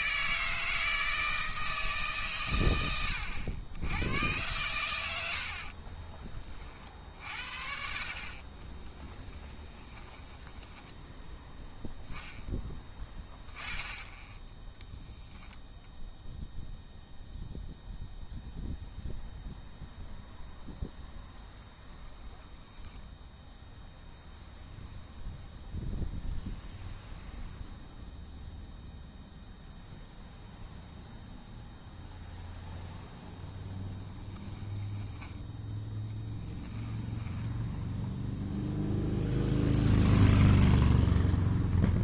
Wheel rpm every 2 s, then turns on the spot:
160, 110, 110, 40, 20, 10, 10, 0, 0, 0, 0, 0, 0, 0, 0, 0, 0, 10, 10, 0, 0.
8-12 36-38